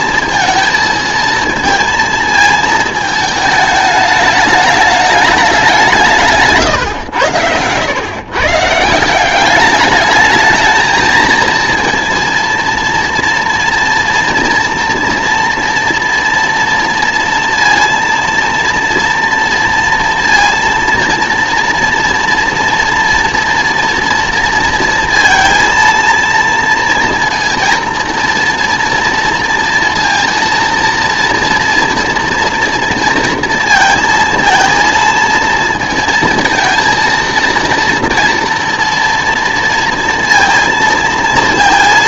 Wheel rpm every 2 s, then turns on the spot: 220, 220, 210, 140, 150, 220, 230, 230, 230, 230, 230, 230, 230, 230, 230, 230, 240, 230, 230, 230, 230.
none